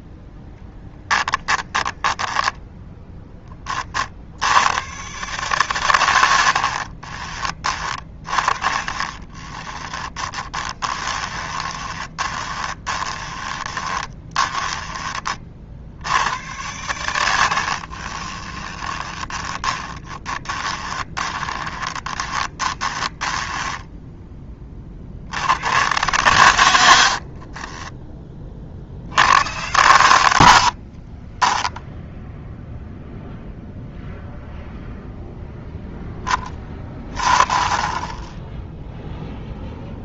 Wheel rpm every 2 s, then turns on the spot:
10, 0, 110, 50, 20, 20, 30, 20, 100, 20, 20, 20, 30, 120, 60, 70, 0, 0, 20, 0.
0-2 6-14 18-24 30-32